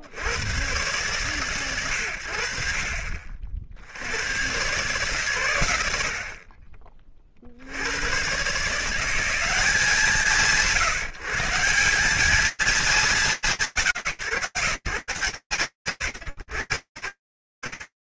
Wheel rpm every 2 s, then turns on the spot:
30, 80, 80, 80, 120, 170, 190, 140, 110.
none